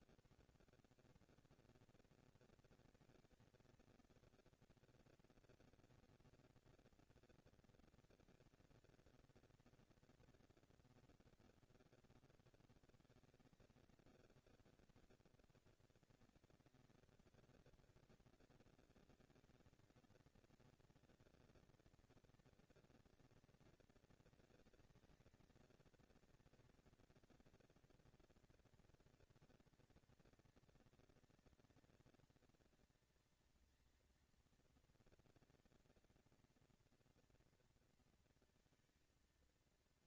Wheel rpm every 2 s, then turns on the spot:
140, 230, 230, 230, 230, 220, 170, 110, 180, 220, 220, 240, 230, 230, 230, 230, 230, 230, 230, 230.
none